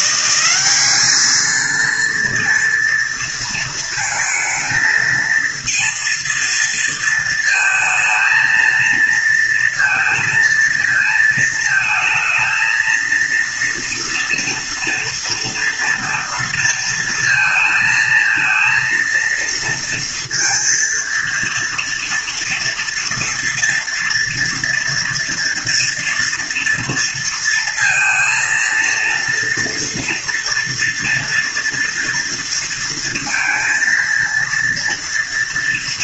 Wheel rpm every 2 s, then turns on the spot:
190, 230, 220, 230, 230, 230, 230, 230, 230, 230, 230, 230, 230, 230, 230, 230, 230, 230.
none